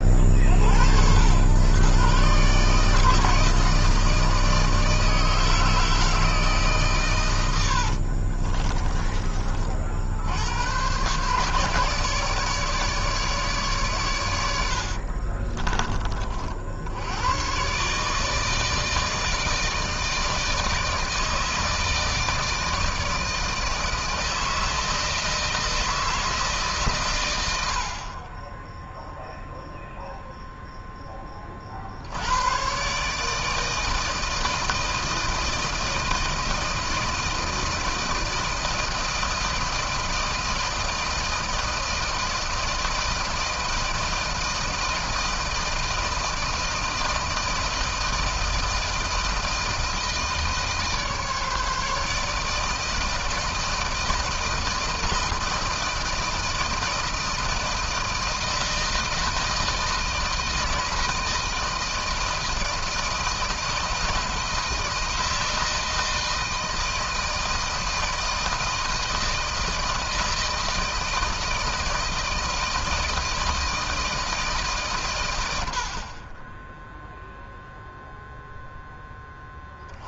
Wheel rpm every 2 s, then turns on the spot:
60, 150, 160, 140, 40, 110, 150, 70, 70, 160, 160, 160, 160, 140, 10, 0, 120, 160, 160, 160, 160, 160, 160, 160, 160, 160, 150, 160, 160, 160, 160, 160, 160, 160, 160, 160, 160, 150, 20, 0.
8-10 14-16